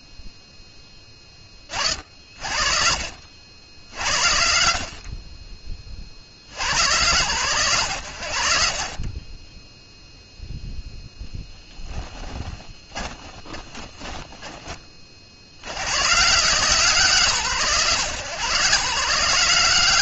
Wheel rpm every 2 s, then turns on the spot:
70, 120, 40, 0, 20, 20, 150, 130, 200, 120.
8-12